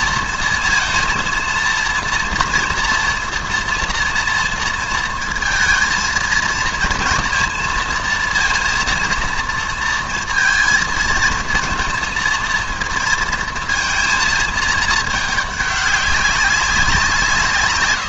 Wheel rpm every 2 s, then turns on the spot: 230, 240, 230, 230, 230, 230, 230, 220, 190.
none